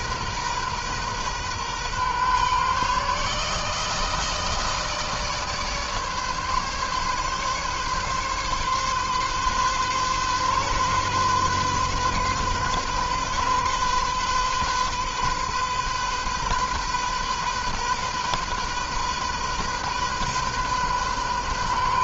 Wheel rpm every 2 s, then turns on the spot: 130, 140, 160, 140, 140, 130, 130, 130, 130, 130, 130.
none